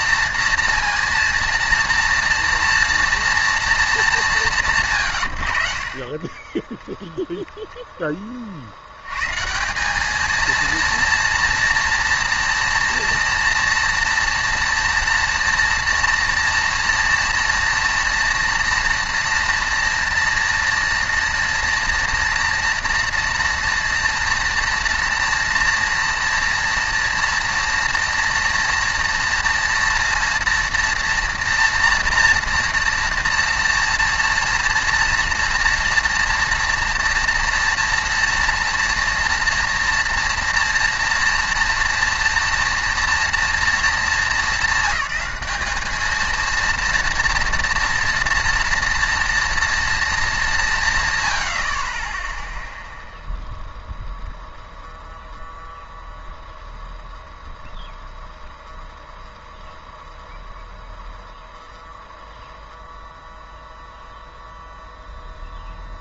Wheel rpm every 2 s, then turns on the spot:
230, 230, 180, 20, 40, 220, 230, 230, 230, 230, 230, 230, 230, 230, 230, 230, 230, 230, 240, 230, 230, 230, 220, 230, 230, 200, 0, 0, 0, 0, 0, 0, 0.
none